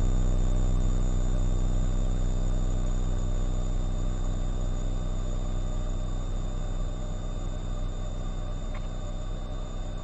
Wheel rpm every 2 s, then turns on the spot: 0, 0, 0, 0, 0.
none